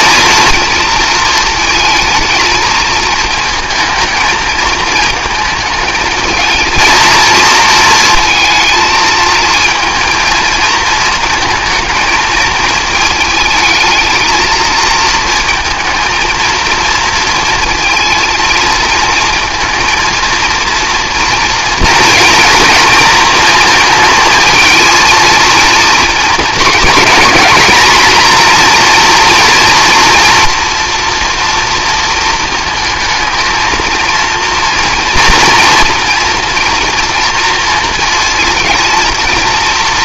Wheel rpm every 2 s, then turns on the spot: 230, 220, 220, 220, 220, 220, 220, 230, 230, 230, 230, 230, 220, 230, 240, 230, 220, 230, 230, 230.
none